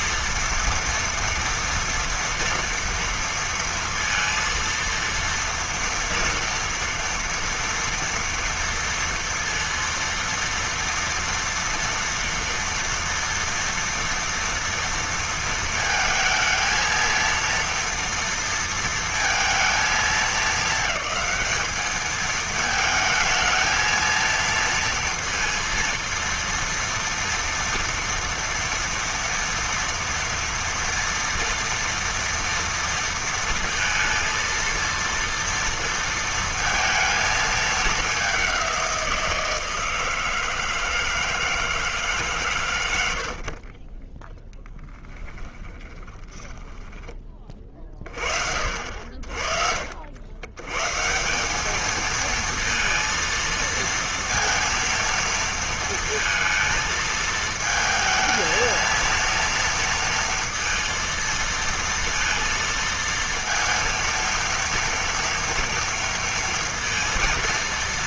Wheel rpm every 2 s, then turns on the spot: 230, 230, 230, 230, 230, 230, 240, 230, 220, 230, 210, 220, 230, 230, 230, 230, 230, 230, 230, 200, 160, 150, 10, 20, 50, 100, 220, 230, 220, 230, 230, 230, 230, 230.
46-48